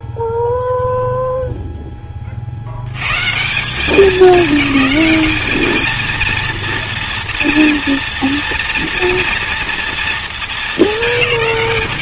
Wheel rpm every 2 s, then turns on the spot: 0, 50, 210, 230, 240, 220.
none